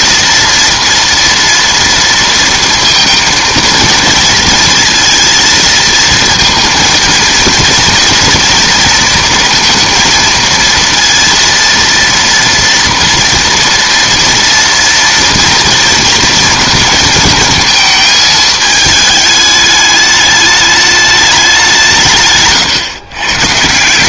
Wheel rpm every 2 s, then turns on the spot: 230, 230, 230, 230, 230, 230, 230, 230, 230, 220, 210, 140.
22-24